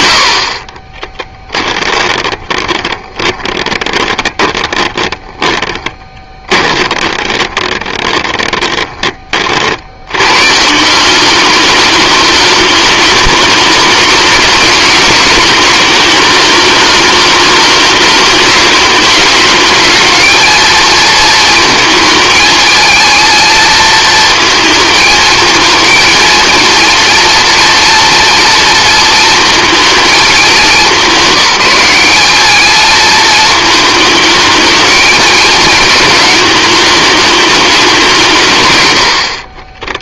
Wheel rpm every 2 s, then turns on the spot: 30, 20, 10, 20, 30, 170, 220, 210, 210, 210, 230, 230, 220, 230, 230, 190, 220, 220, 210, 100.
0-10